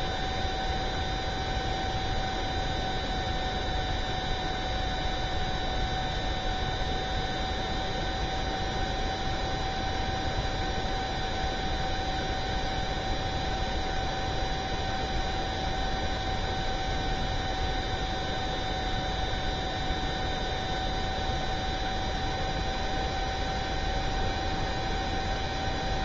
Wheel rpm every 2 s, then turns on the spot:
0, 0, 0, 0, 0, 0, 0, 0, 0, 0, 0, 0, 0.
none